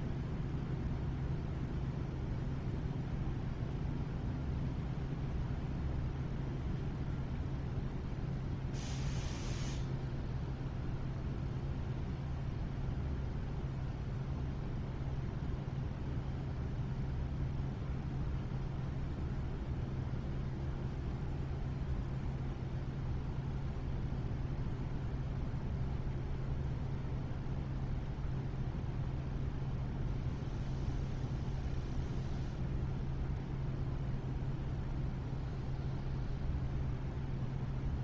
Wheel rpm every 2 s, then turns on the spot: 0, 0, 0, 0, 0, 0, 0, 0, 0, 0, 0, 0, 0, 0, 0, 0, 0, 0, 0.
none